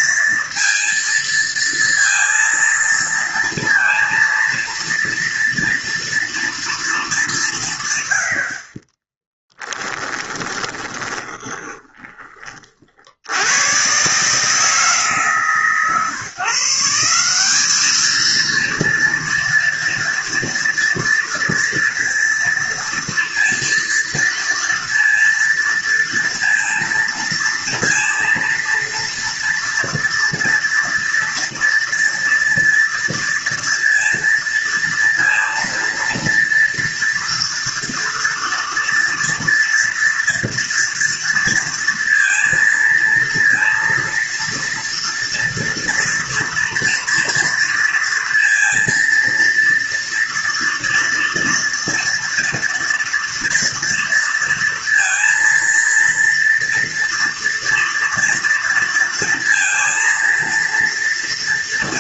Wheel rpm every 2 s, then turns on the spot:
230, 230, 230, 230, 50, 10, 40, 150, 160, 230, 230, 230, 230, 230, 230, 230, 230, 230, 230, 230, 230, 230, 230, 230, 230, 230, 230, 230, 230, 230, 230.
10-12